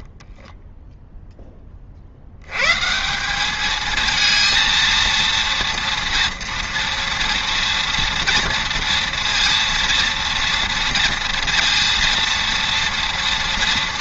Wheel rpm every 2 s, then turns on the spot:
10, 120, 230, 230, 230, 230, 230.
0-2